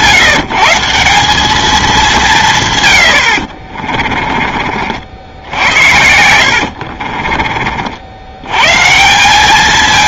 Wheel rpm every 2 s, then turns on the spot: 150, 140, 40, 60, 140.
6-8